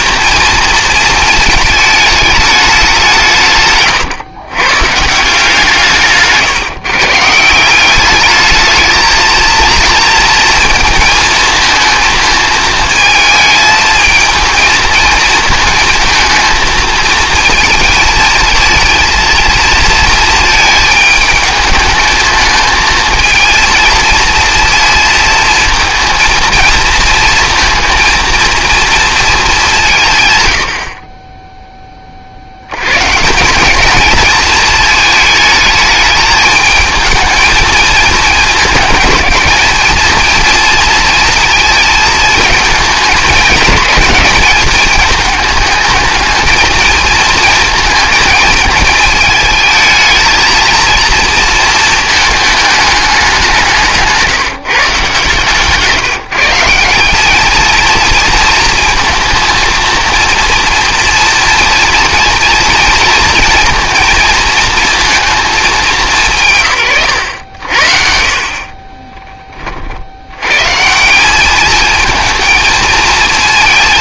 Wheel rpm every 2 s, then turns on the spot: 220, 190, 130, 140, 220, 220, 220, 220, 220, 220, 220, 230, 230, 230, 230, 60, 100, 220, 220, 220, 230, 210, 210, 220, 220, 230, 210, 150, 190, 230, 230, 220, 230, 140, 30, 150, 230.
68-70